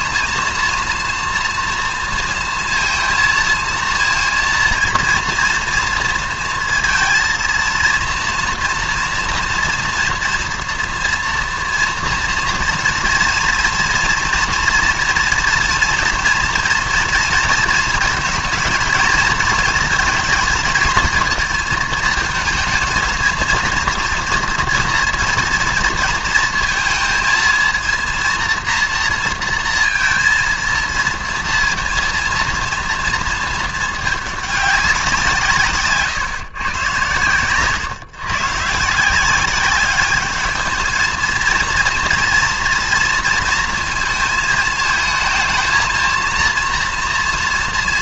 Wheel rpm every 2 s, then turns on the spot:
230, 230, 230, 230, 230, 230, 240, 230, 230, 230, 230, 230, 230, 230, 230, 230, 230, 200, 130, 140, 220, 230, 220, 230.
none